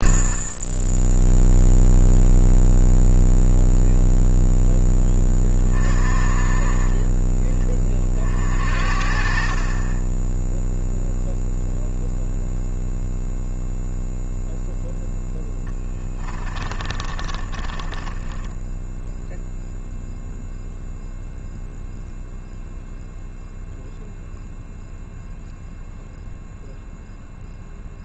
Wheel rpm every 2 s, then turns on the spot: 20, 0, 0, 30, 50, 0, 0, 0, 30, 10, 0, 0, 0, 0.
16-20